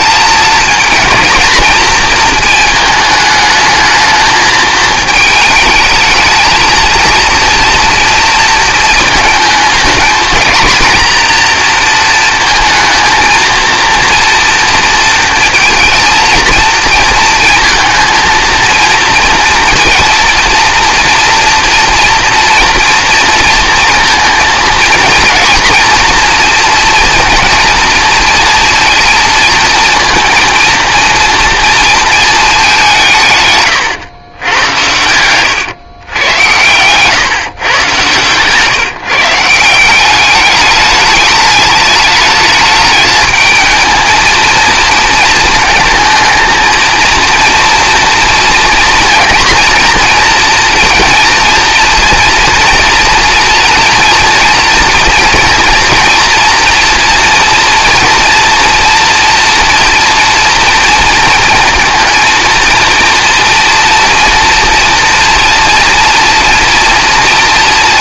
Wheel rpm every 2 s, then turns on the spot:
220, 220, 220, 220, 230, 230, 230, 230, 230, 230, 240, 240, 230, 230, 230, 230, 210, 100, 120, 140, 210, 220, 230, 220, 230, 230, 230, 240, 240, 230, 230, 230, 230, 230.
none